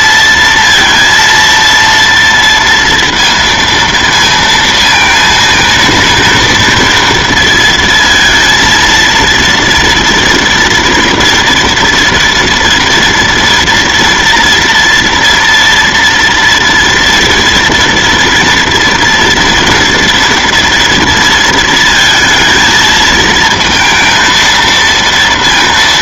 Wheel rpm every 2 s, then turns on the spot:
230, 230, 230, 230, 230, 230, 240, 240, 230, 230, 230, 230, 230.
none